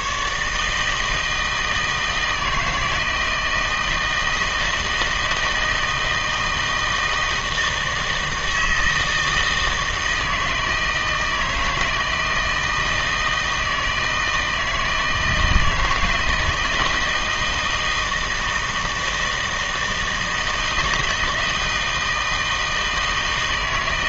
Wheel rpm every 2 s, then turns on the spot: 150, 160, 160, 160, 160, 160, 160, 160, 160, 160, 160, 160.
none